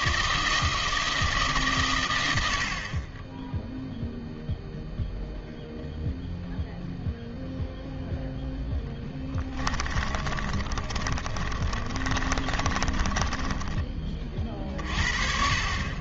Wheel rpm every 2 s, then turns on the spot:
160, 40, 0, 0, 10, 30, 20, 50.
10-14